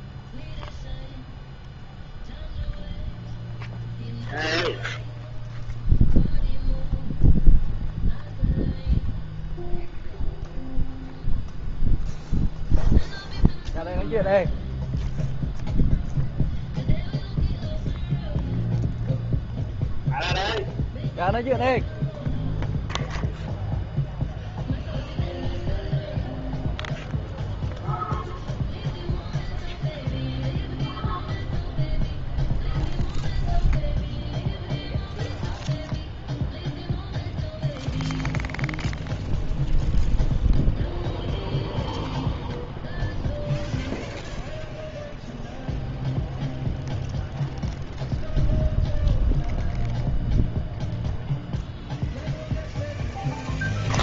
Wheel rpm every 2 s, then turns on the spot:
0, 0, 0, 0, 0, 0, 0, 0, 0, 0, 0, 0, 0, 0, 0, 0, 0, 0, 0, 0, 0, 0, 0, 0, 0, 0, 0.
none